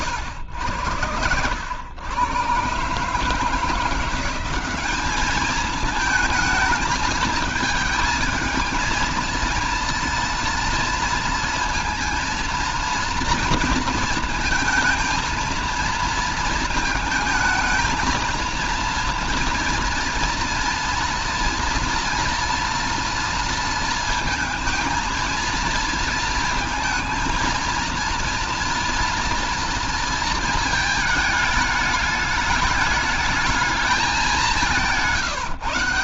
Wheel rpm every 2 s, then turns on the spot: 100, 120, 190, 220, 220, 230, 230, 220, 220, 230, 230, 230, 220, 220, 230, 230, 210, 200.
none